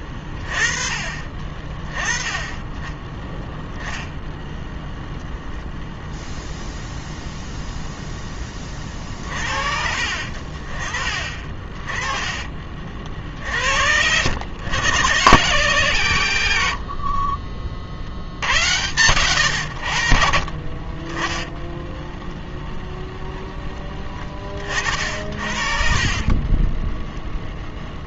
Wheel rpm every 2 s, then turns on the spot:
30, 10, 0, 0, 30, 40, 40, 100, 70, 100, 30, 0, 50, 20.
26-28